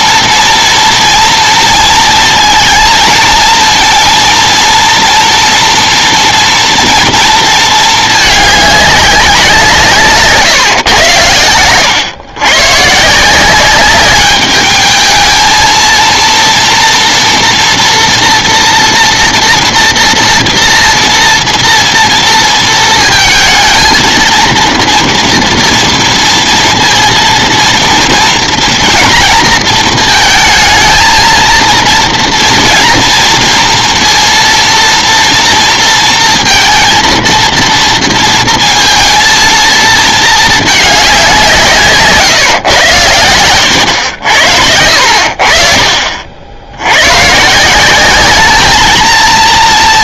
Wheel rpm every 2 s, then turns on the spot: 230, 230, 230, 240, 210, 130, 120, 210, 230, 230, 230, 230, 230, 230, 230, 230, 230, 230, 230, 230, 210, 120, 70, 70, 210.
none